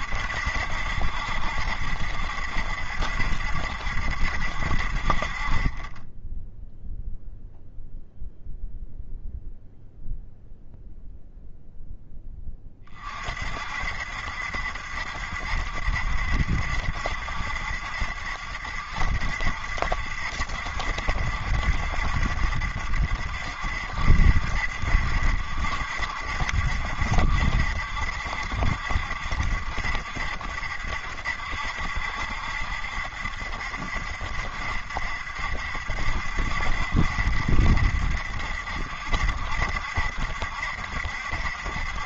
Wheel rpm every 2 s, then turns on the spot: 70, 70, 60, 0, 0, 0, 20, 70, 70, 70, 70, 70, 70, 70, 70, 70, 70, 60, 70, 60, 70.
none